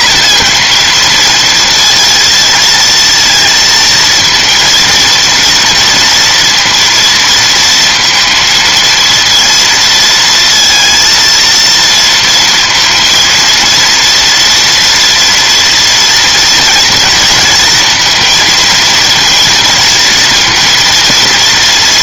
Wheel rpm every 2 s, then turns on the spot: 250, 230, 230, 230, 230, 230, 230, 240, 230, 220, 230.
none